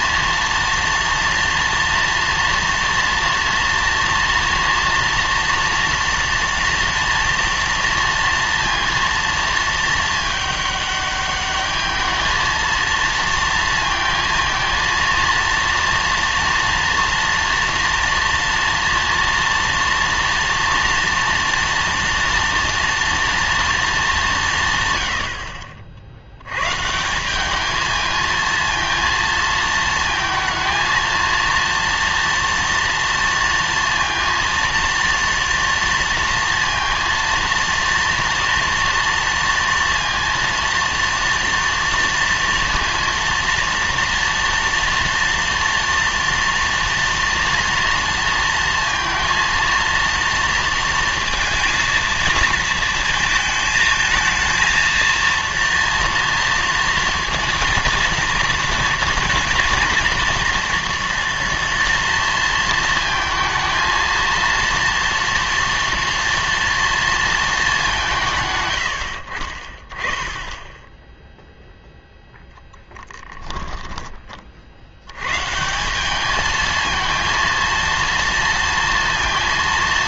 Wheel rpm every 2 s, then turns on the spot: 230, 230, 230, 230, 230, 210, 220, 230, 230, 230, 230, 230, 130, 130, 230, 230, 230, 230, 230, 230, 230, 230, 230, 230, 230, 230, 220, 230, 230, 230, 230, 230, 230, 230, 110, 10, 0, 70, 220, 230.
none